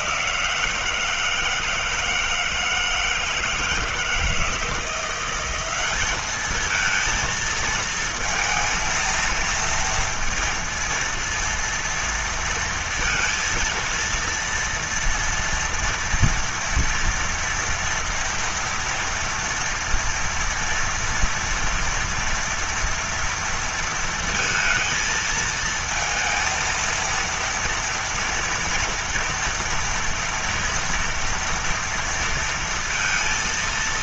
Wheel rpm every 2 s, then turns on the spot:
180, 160, 160, 210, 230, 230, 230, 230, 240, 230, 230, 240, 230, 230, 230, 230, 230.
none